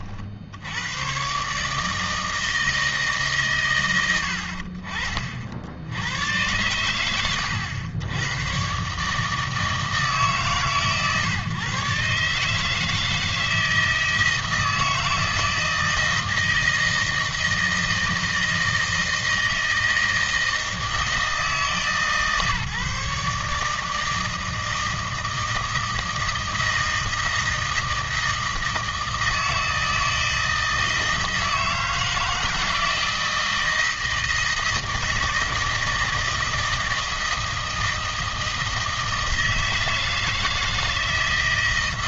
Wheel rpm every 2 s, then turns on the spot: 80, 160, 50, 100, 110, 140, 150, 160, 160, 160, 160, 140, 160, 160, 160, 160, 160, 160, 160, 160, 170.
none